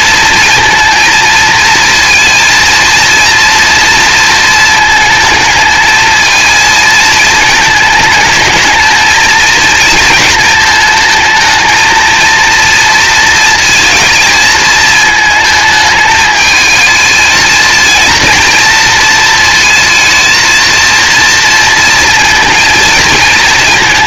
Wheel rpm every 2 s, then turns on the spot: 230, 230, 230, 220, 220, 220, 230, 220, 220, 230, 230, 230.
none